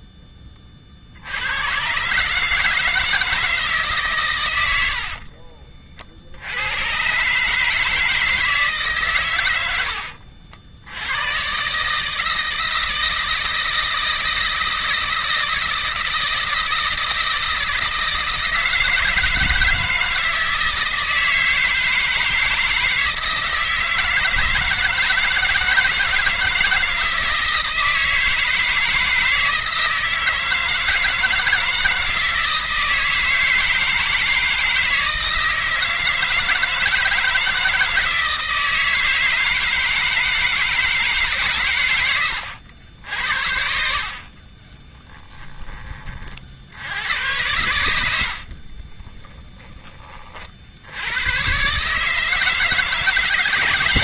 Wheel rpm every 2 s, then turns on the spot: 70, 160, 60, 120, 130, 110, 160, 160, 160, 160, 160, 160, 160, 160, 160, 160, 160, 160, 160, 160, 150, 80, 30, 80, 20, 100, 150.
4-6 44-46 48-50